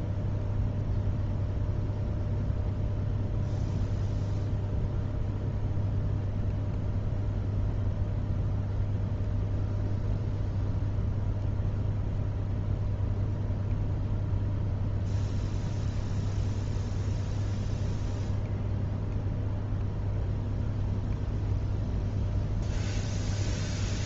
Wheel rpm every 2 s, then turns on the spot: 0, 0, 0, 0, 0, 0, 0, 0, 0, 0, 0, 0.
none